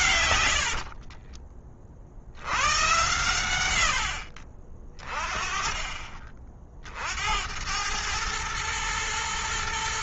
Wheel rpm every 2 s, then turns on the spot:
60, 90, 40, 50, 110.
0-2